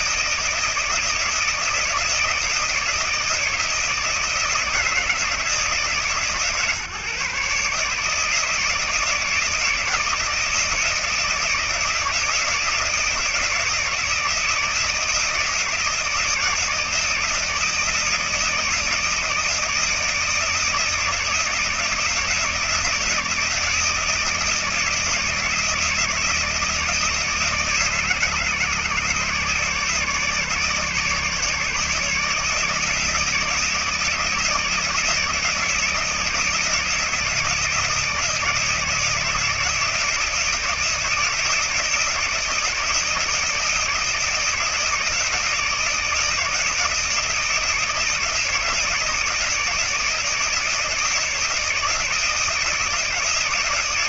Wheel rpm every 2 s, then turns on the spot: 160, 160, 170, 150, 150, 160, 160, 160, 160, 160, 160, 160, 160, 160, 160, 150, 150, 160, 160, 160, 160, 160, 160, 160, 160, 160, 160.
none